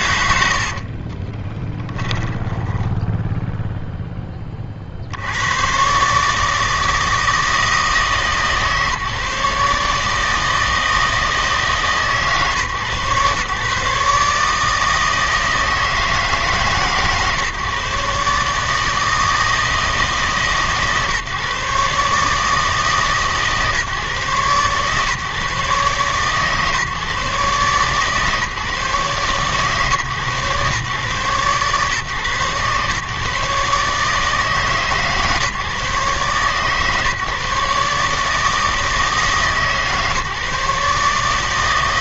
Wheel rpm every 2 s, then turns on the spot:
80, 20, 40, 160, 150, 160, 140, 150, 150, 150, 150, 150, 140, 140, 140, 120, 130, 150, 130, 160, 150.
2-4